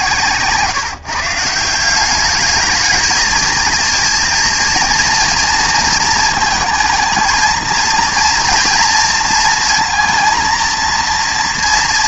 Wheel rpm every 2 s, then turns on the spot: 140, 210, 230, 220, 230, 230.
none